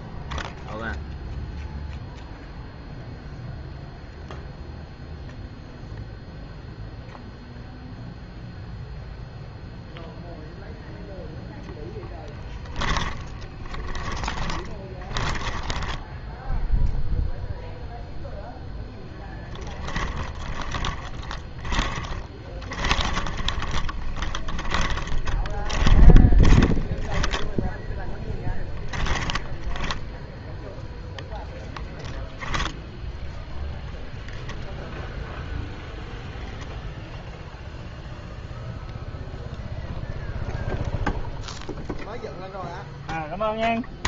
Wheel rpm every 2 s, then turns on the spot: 0, 0, 0, 0, 0, 0, 20, 30, 0, 0, 20, 20, 20, 10, 10, 0, 10, 0, 0, 0, 0, 0.
12-16 20-30